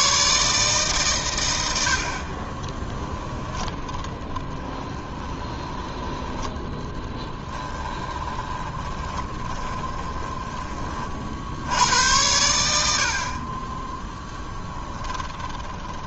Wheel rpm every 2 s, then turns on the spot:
140, 20, 20, 10, 20, 20, 70, 10.
2-6 8-10 14-16